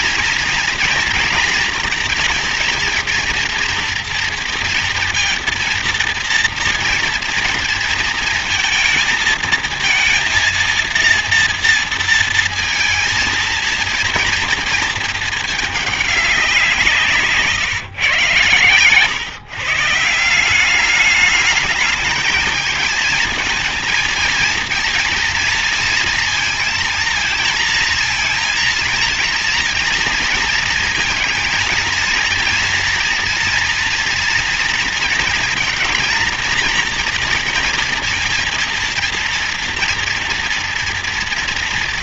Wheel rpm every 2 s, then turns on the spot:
230, 230, 230, 230, 230, 230, 230, 220, 190, 130, 180, 220, 230, 230, 230, 230, 230, 230, 230, 230, 230.
none